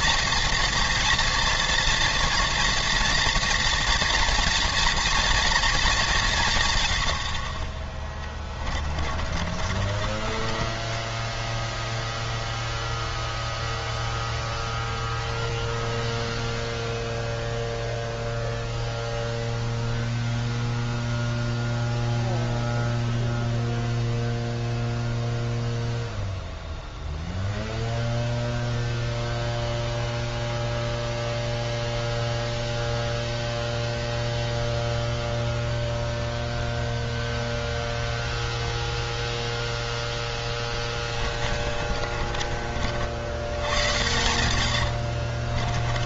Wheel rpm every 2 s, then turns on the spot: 230, 230, 230, 110, 30, 30, 0, 0, 0, 0, 0, 0, 0, 0, 0, 0, 0, 0, 0, 0, 20, 40, 80.
8-12 40-42 44-46